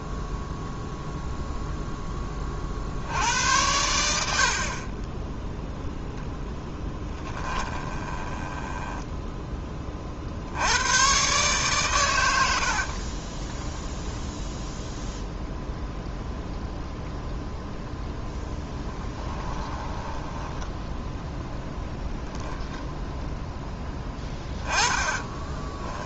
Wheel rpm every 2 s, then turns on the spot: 0, 40, 60, 10, 10, 80, 60, 0, 0, 10, 10, 0, 10.
6-10 18-22 24-26